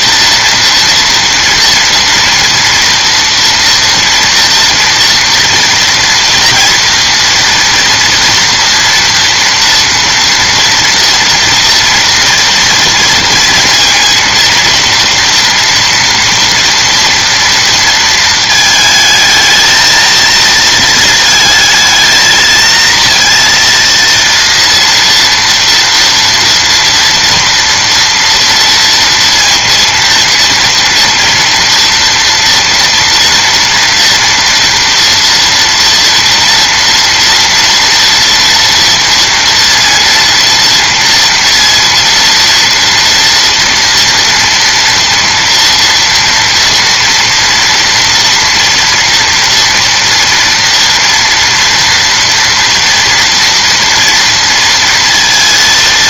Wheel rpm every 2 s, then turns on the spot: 230, 230, 230, 230, 240, 240, 230, 230, 240, 220, 230, 220, 230, 230, 230, 230, 230, 230, 230, 240, 230, 240, 230, 230, 230, 230, 230, 230.
none